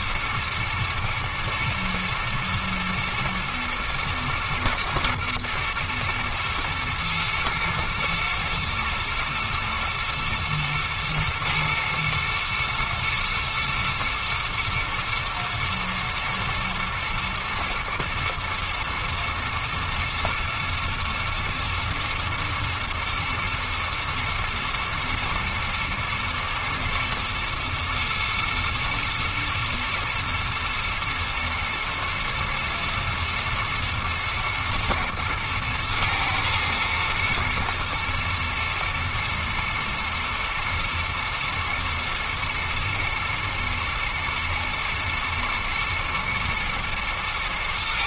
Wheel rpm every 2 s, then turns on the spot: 120, 120, 120, 120, 110, 120, 120, 110, 110, 120, 110, 120, 110, 110, 120, 110, 110, 110, 110, 110, 110, 110, 110, 110.
none